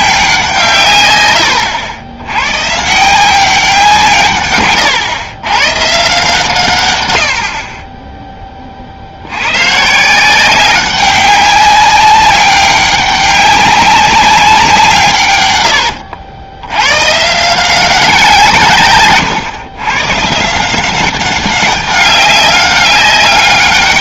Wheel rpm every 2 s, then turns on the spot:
150, 130, 120, 140, 40, 190, 200, 180, 100, 140, 170, 200.
4-6